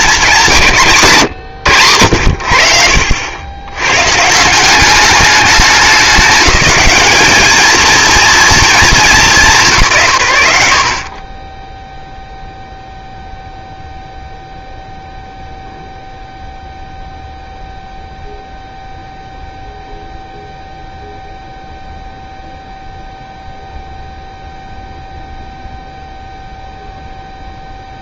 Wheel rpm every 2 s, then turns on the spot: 180, 70, 190, 200, 220, 70, 0, 0, 0, 0, 0, 0, 0, 0.
none